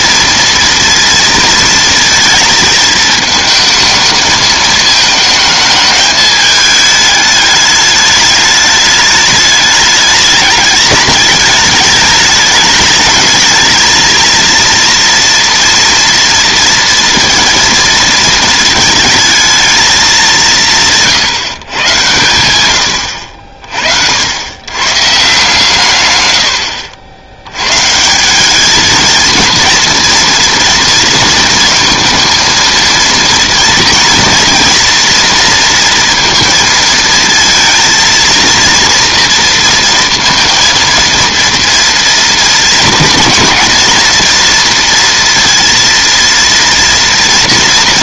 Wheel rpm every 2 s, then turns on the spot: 230, 230, 220, 210, 210, 210, 210, 230, 230, 230, 180, 120, 110, 90, 200, 230, 230, 230, 230, 230, 230, 230, 230, 230.
none